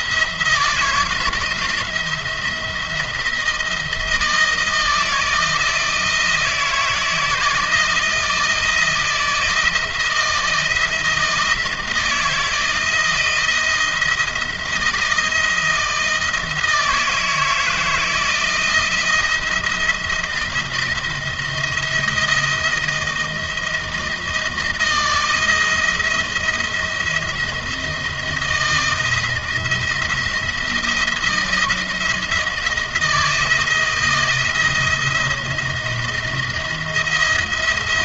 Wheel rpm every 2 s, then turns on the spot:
170, 170, 160, 160, 170, 170, 170, 160, 160, 170, 170, 170, 160, 170, 160, 170, 160, 170, 170.
none